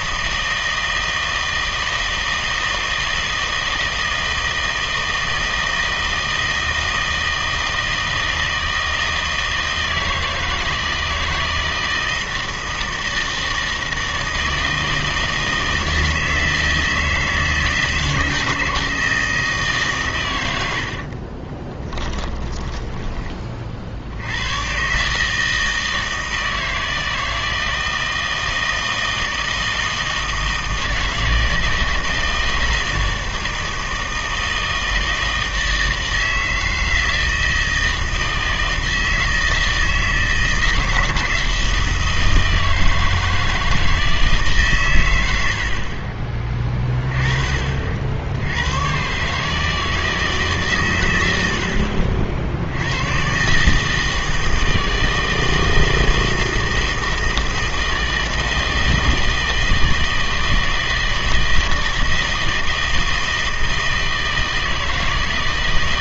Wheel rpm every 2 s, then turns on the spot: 160, 160, 160, 160, 160, 160, 160, 160, 160, 160, 80, 10, 110, 160, 160, 160, 160, 160, 160, 160, 160, 160, 140, 20, 110, 140, 70, 160, 160, 160, 160, 160, 160.
22-24